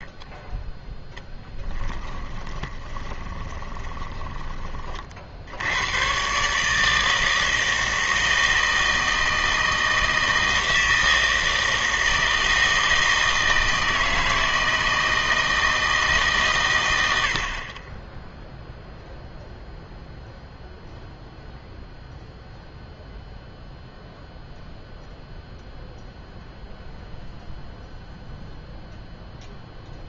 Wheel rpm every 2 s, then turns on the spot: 10, 10, 40, 160, 160, 160, 160, 160, 110, 0, 0, 0, 0, 0, 0.
2-4